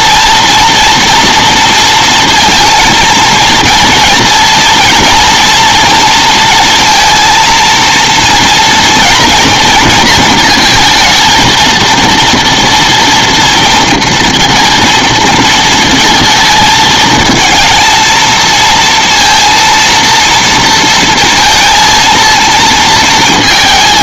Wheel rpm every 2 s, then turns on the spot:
230, 230, 230, 230, 230, 220, 230, 230, 220, 230, 230, 230.
none